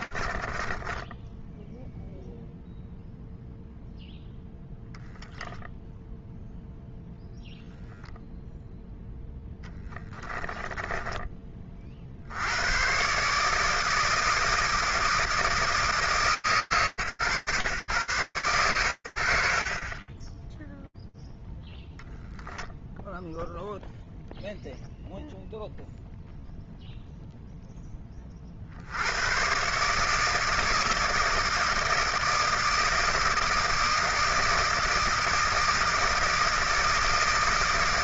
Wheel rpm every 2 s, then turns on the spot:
20, 0, 0, 0, 0, 20, 80, 160, 140, 100, 20, 0, 0, 0, 110, 160, 160, 160, 160.
0-2 10-12